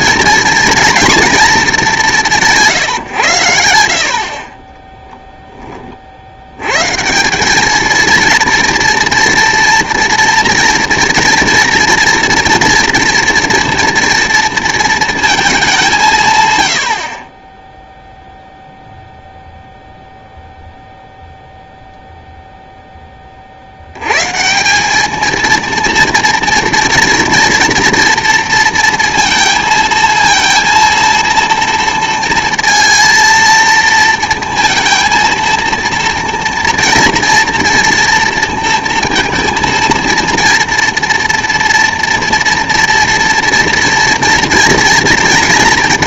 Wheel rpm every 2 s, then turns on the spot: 230, 140, 20, 120, 230, 230, 230, 230, 80, 0, 0, 10, 190, 230, 230, 230, 230, 230, 230, 230, 230, 230, 230.
none